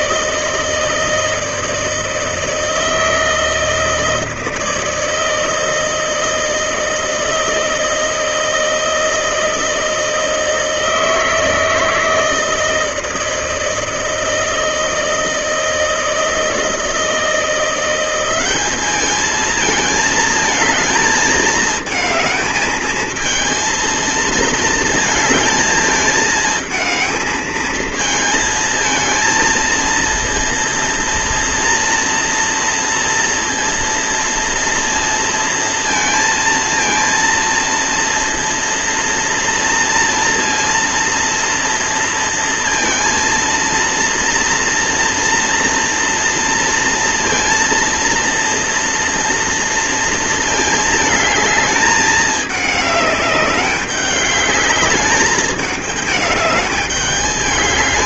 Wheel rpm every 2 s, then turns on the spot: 160, 160, 160, 160, 160, 160, 160, 160, 160, 200, 220, 220, 220, 220, 220, 230, 240, 230, 230, 230, 230, 230, 230, 230, 230, 220, 210, 200, 210.
none